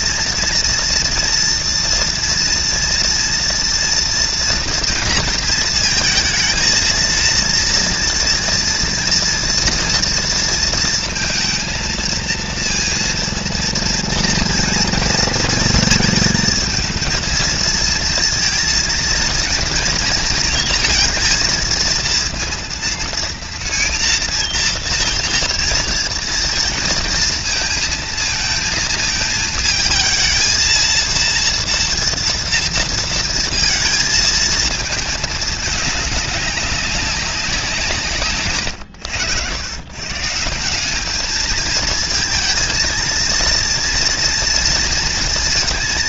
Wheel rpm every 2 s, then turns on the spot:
230, 230, 230, 220, 230, 230, 230, 230, 230, 230, 230, 230, 230, 230, 230, 220, 230, 220, 200, 130, 170, 230, 230.
none